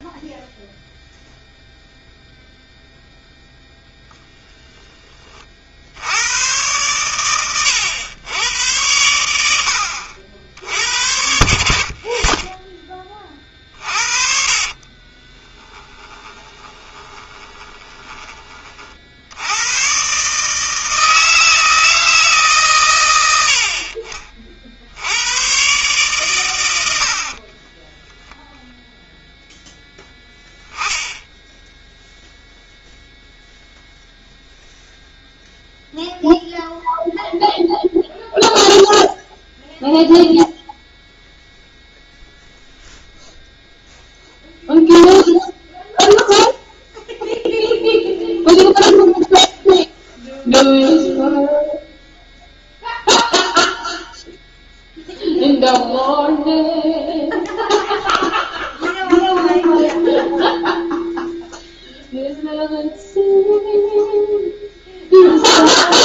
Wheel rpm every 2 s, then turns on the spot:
0, 0, 10, 110, 100, 80, 20, 50, 20, 40, 160, 130, 60, 90, 0, 10, 0, 0, 0, 0, 0, 0, 0, 0, 0, 0, 0, 0, 0, 0, 0, 0, 0.
14-18